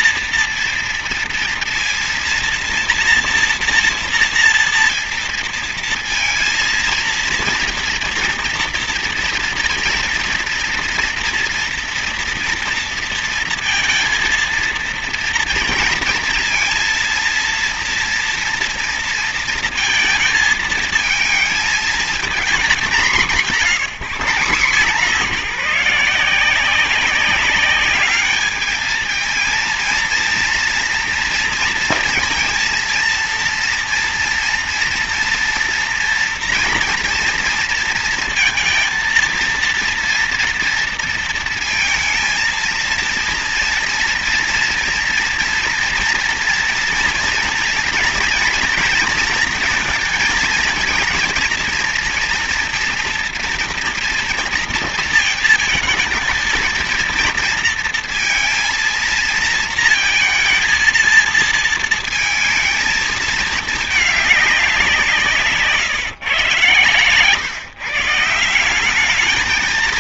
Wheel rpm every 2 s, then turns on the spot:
230, 230, 230, 230, 230, 230, 240, 230, 230, 230, 220, 220, 190, 170, 210, 230, 230, 230, 230, 230, 230, 230, 230, 230, 230, 220, 230, 230, 220, 230, 230, 230, 200, 130, 180.
none